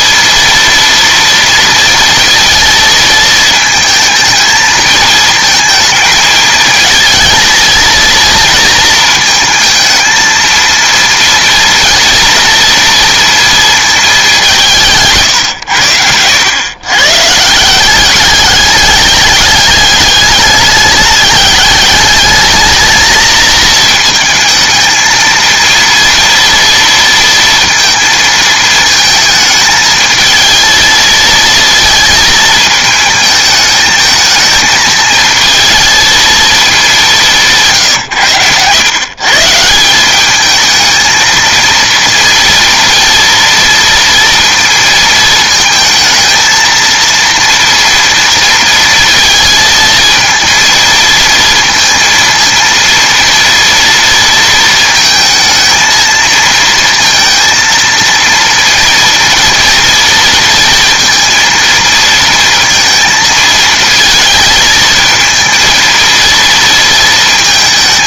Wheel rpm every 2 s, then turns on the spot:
230, 230, 220, 220, 230, 230, 230, 170, 120, 210, 210, 220, 220, 230, 220, 220, 220, 220, 210, 120, 220, 230, 230, 230, 230, 230, 230, 230, 230, 230, 230, 230, 220, 230.
none